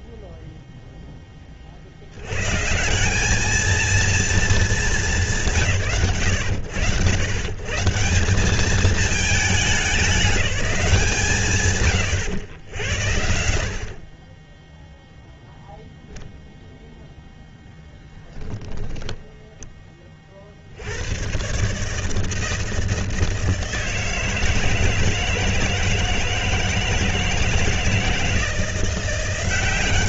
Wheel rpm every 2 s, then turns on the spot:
0, 120, 230, 80, 160, 200, 100, 20, 0, 10, 110, 160, 160, 160, 180.
none